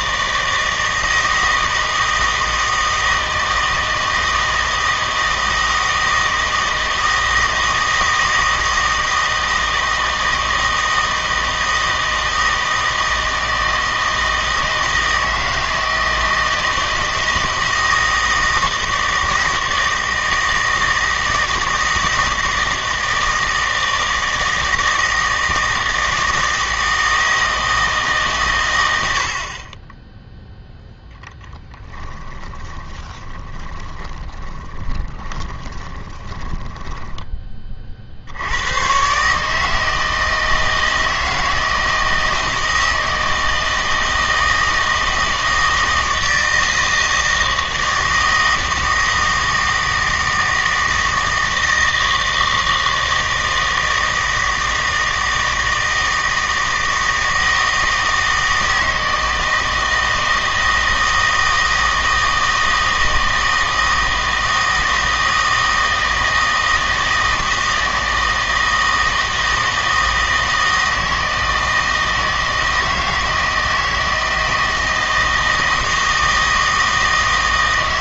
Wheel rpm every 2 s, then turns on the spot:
160, 160, 160, 160, 160, 160, 160, 160, 160, 160, 160, 160, 160, 160, 100, 0, 20, 20, 10, 100, 160, 160, 160, 160, 160, 160, 160, 160, 160, 160, 160, 160, 160, 160, 160, 160, 160, 160, 160.
32-38